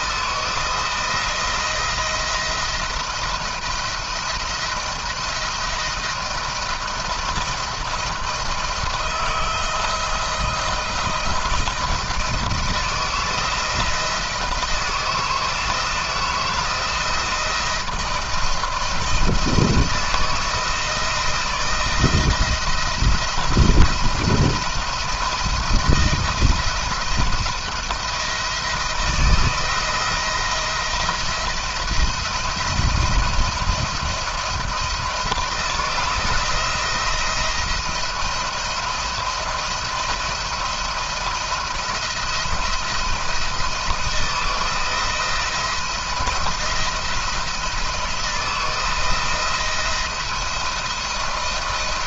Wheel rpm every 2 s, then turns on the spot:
170, 170, 160, 170, 170, 160, 170, 160, 170, 170, 160, 170, 170, 170, 170, 160, 160, 160, 170, 170, 170, 170, 160, 160, 170, 170.
none